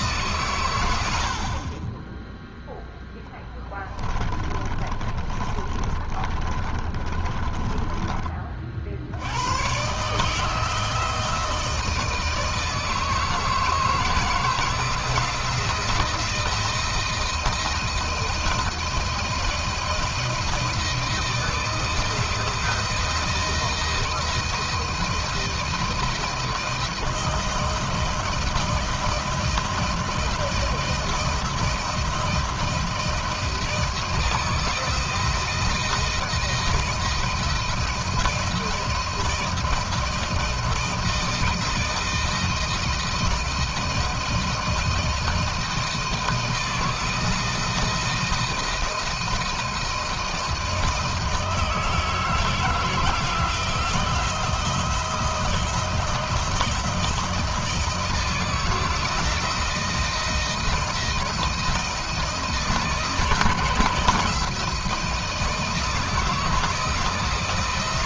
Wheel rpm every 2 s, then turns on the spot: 90, 10, 30, 30, 60, 160, 160, 160, 160, 160, 160, 160, 160, 160, 160, 170, 170, 160, 170, 160, 160, 160, 160, 160, 160, 160, 160, 160, 160, 160, 160, 160, 170, 160.
2-8